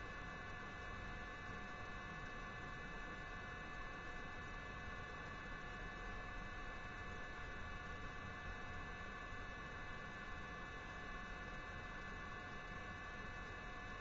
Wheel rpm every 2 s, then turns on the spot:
0, 0, 0, 0, 0, 0, 0.
none